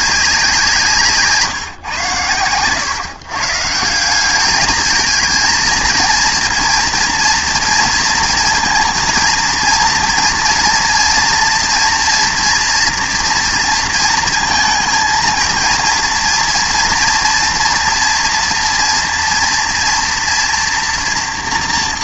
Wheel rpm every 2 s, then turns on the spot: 170, 120, 210, 240, 230, 240, 230, 220, 230, 230, 230.
none